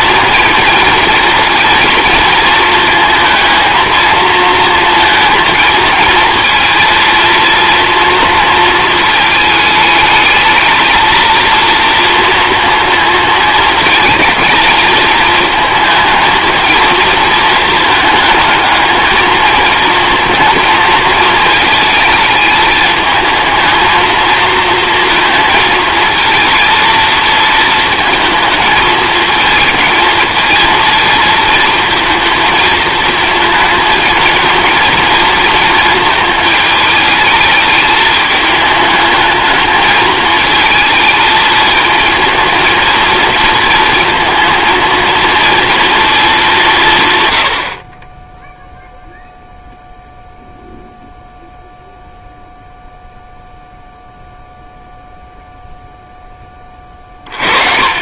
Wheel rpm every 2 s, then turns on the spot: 230, 230, 230, 230, 220, 230, 230, 220, 220, 220, 220, 220, 230, 230, 220, 220, 220, 230, 210, 210, 220, 230, 230, 170, 0, 0, 0, 0, 20.
none